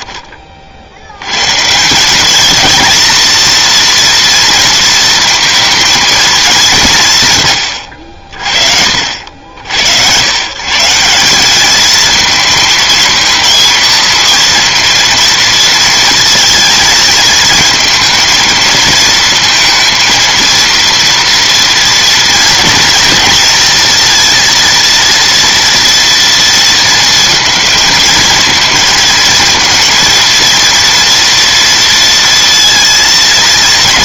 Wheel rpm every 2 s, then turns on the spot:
30, 220, 230, 210, 50, 130, 230, 230, 230, 220, 230, 230, 230, 230, 220, 230, 230.
none